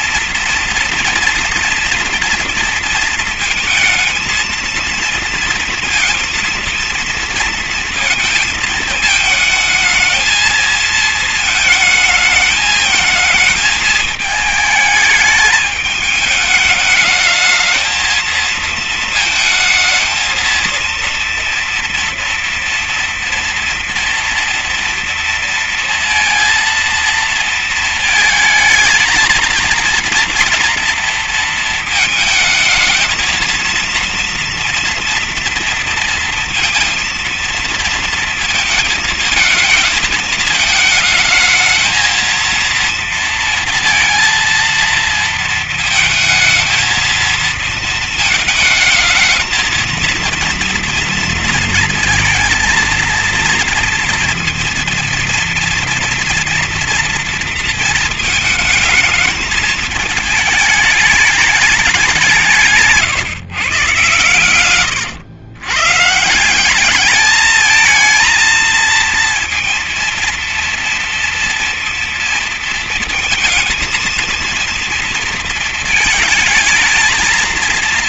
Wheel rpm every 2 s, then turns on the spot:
240, 230, 230, 230, 220, 220, 220, 210, 210, 220, 230, 240, 230, 230, 220, 230, 220, 230, 230, 230, 220, 230, 230, 220, 220, 230, 230, 240, 230, 220, 210, 140, 130, 210, 230, 230, 230, 230, 230.
none